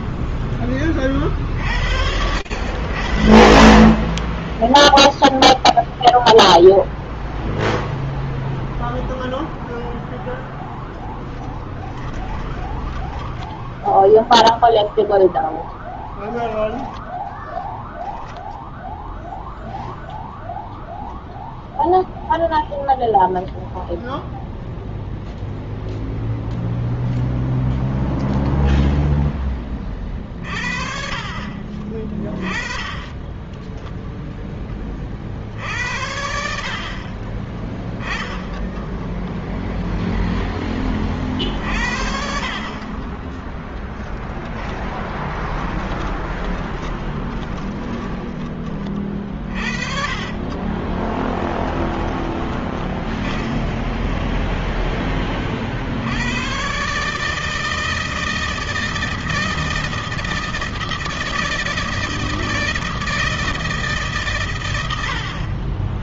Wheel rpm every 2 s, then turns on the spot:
30, 60, 0, 0, 0, 10, 10, 0, 10, 0, 0, 0, 0, 0, 0, 50, 10, 40, 40, 0, 30, 30, 20, 10, 30, 20, 10, 10, 140, 160, 160, 160, 70.
32-34 42-54